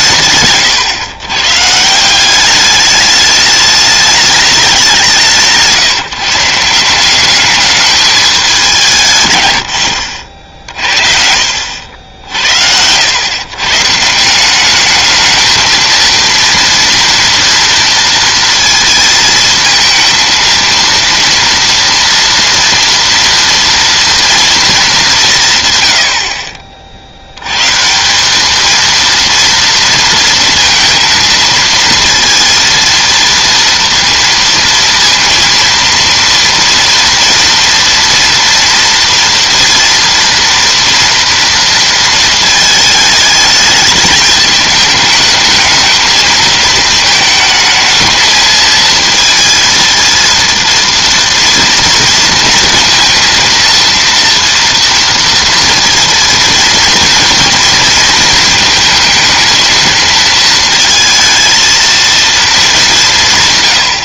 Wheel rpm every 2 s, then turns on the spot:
120, 210, 190, 180, 160, 50, 90, 200, 230, 230, 230, 240, 210, 40, 220, 230, 230, 230, 230, 230, 240, 220, 220, 220, 230, 230, 230, 230, 230, 220, 220, 190.
none